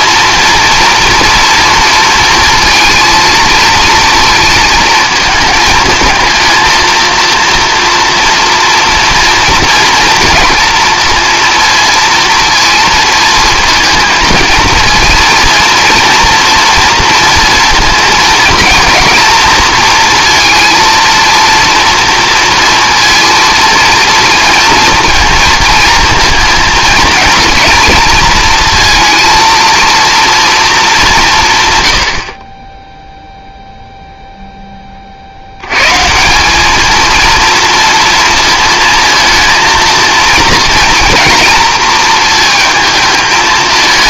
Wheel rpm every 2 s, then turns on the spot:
230, 230, 220, 230, 230, 230, 230, 220, 230, 230, 230, 230, 230, 230, 230, 210, 20, 20, 210, 230, 230, 220.
none